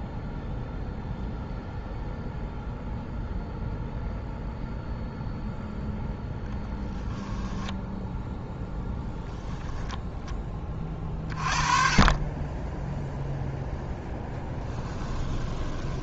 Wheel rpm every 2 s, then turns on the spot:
0, 0, 0, 0, 0, 20, 10, 10.
14-16